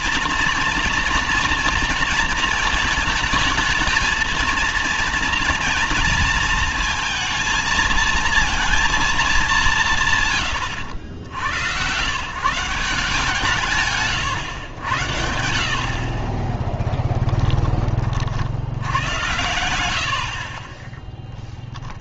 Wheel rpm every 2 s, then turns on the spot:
230, 220, 220, 230, 230, 110, 160, 110, 20, 80, 30.
16-18